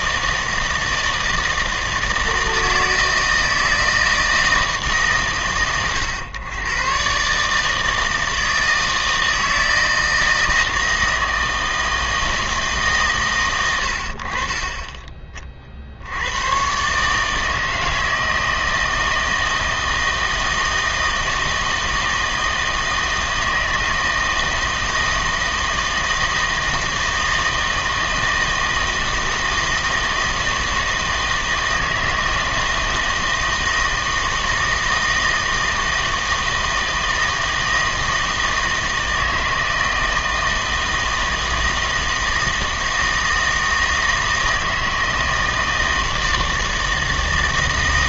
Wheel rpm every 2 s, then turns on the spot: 160, 160, 160, 110, 160, 160, 140, 20, 130, 160, 160, 160, 160, 160, 160, 160, 160, 160, 160, 160, 160, 160, 160, 160.
none